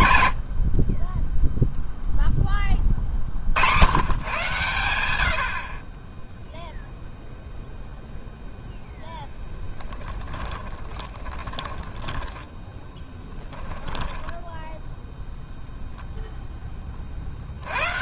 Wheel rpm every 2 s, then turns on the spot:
20, 60, 80, 0, 10, 20, 10, 0, 190.
8-14